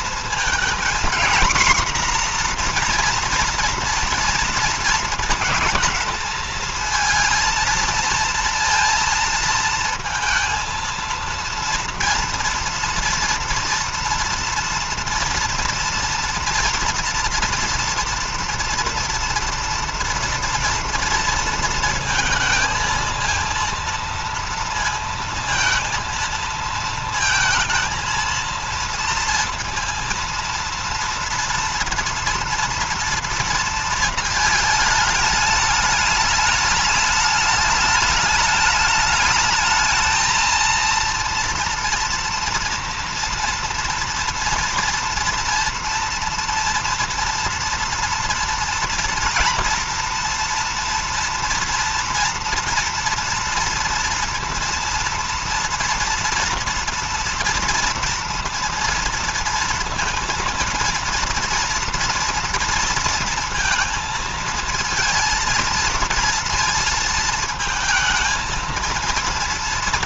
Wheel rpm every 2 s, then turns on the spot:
240, 240, 230, 220, 230, 230, 230, 230, 230, 230, 230, 230, 230, 230, 230, 230, 230, 220, 210, 210, 230, 230, 230, 230, 230, 230, 230, 230, 230, 230, 230, 230, 230, 230, 230.
none